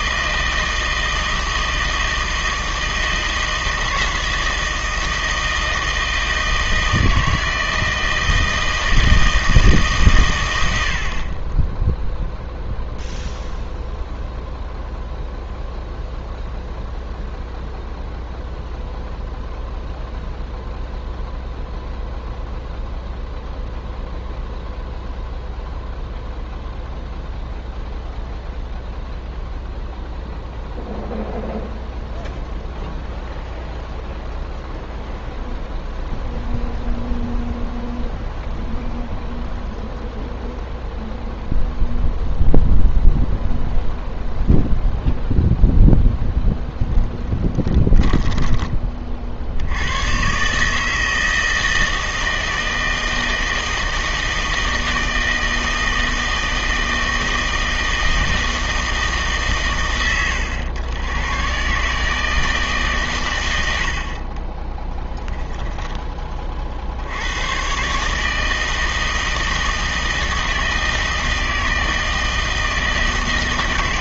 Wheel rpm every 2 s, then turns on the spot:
160, 160, 160, 160, 160, 80, 0, 0, 0, 0, 0, 0, 0, 0, 0, 0, 0, 0, 0, 0, 0, 0, 0, 0, 20, 150, 160, 160, 160, 160, 100, 150, 20, 50, 160, 160, 160.
64-66